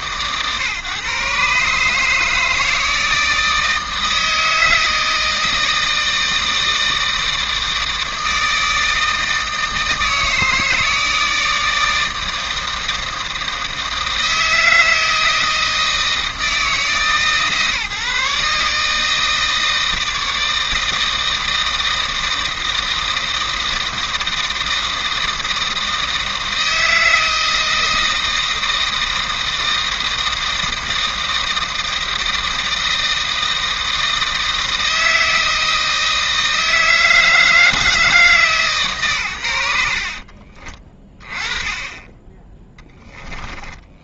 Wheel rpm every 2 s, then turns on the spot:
130, 160, 160, 160, 160, 160, 160, 160, 160, 150, 160, 160, 160, 160, 160, 160, 160, 160, 160, 130, 30, 10.
42-44